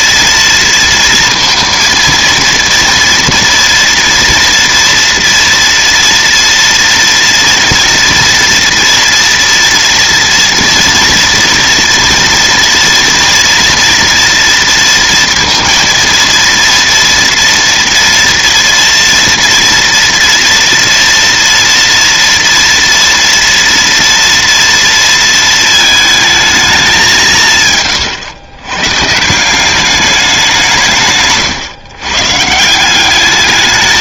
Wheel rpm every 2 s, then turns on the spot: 230, 230, 230, 240, 240, 240, 230, 230, 230, 230, 230, 230, 230, 200, 140, 150, 180.
none